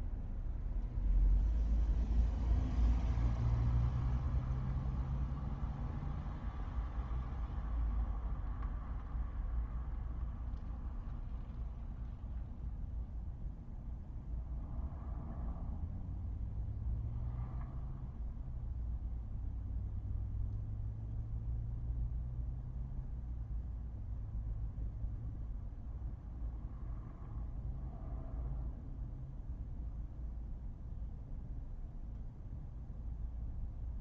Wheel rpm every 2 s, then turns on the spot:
0, 0, 0, 0, 0, 0, 0, 0, 0, 0, 0, 0, 0, 0, 0, 0, 0.
none